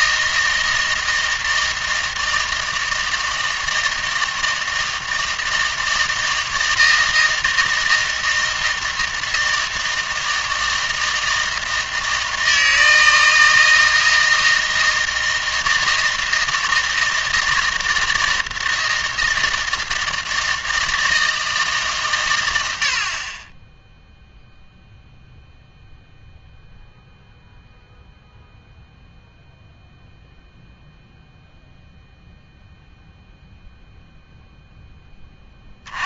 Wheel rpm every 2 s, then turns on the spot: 160, 160, 160, 160, 160, 160, 160, 160, 160, 160, 160, 80, 0, 0, 0, 0, 0, 0.
none